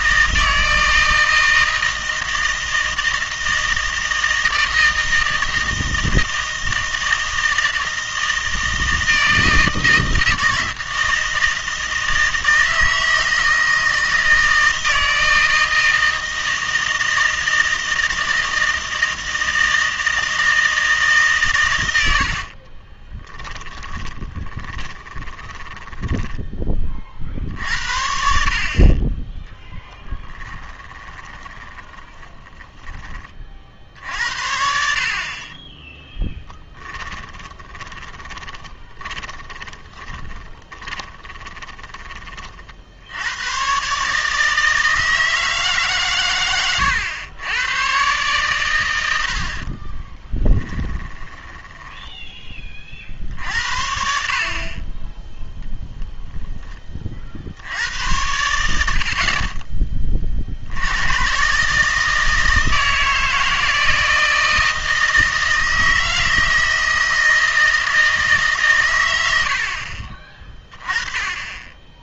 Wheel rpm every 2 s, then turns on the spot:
160, 160, 160, 160, 160, 160, 160, 160, 160, 160, 160, 40, 20, 20, 50, 20, 20, 60, 10, 20, 20, 50, 160, 110, 120, 20, 30, 40, 10, 80, 70, 160, 160, 160, 130, 20.
22-26 30-34 36-42 46-48 50-52